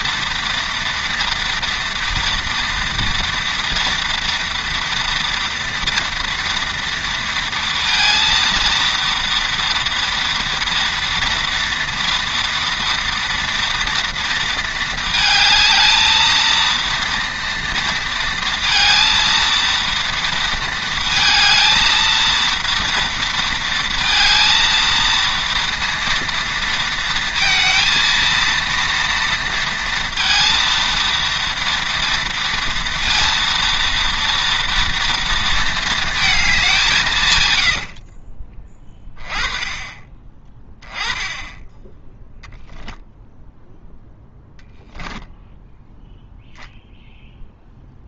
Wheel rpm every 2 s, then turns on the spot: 230, 230, 230, 230, 230, 230, 230, 230, 230, 230, 230, 230, 230, 230, 230, 230, 230, 230, 220, 30, 20, 0, 0, 0.
none